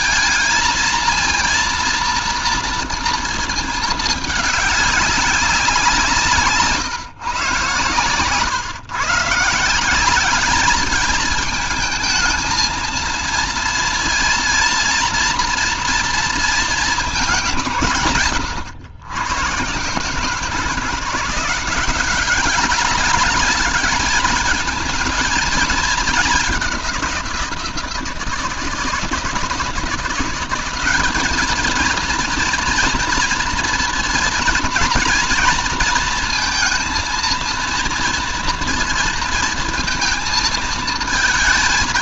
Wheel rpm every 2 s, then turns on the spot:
230, 230, 210, 160, 120, 200, 220, 230, 220, 120, 160, 190, 220, 200, 160, 190, 230, 230, 230, 230, 230.
none